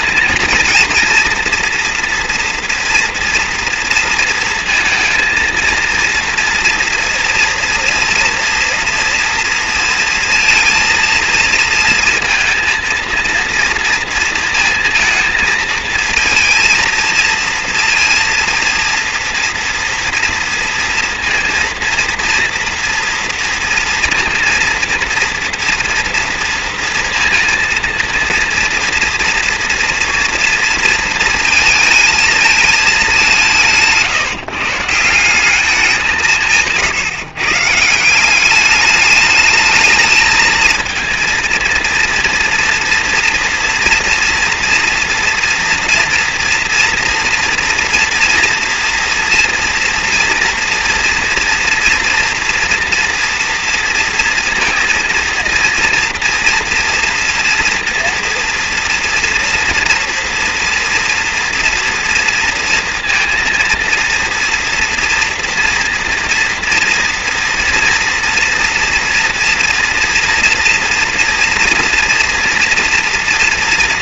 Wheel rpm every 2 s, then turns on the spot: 230, 230, 230, 230, 230, 230, 230, 220, 230, 230, 240, 240, 230, 230, 230, 230, 220, 150, 150, 200, 220, 230, 230, 230, 230, 230, 230, 230, 230, 230, 230, 230, 240, 230, 240, 230, 240.
none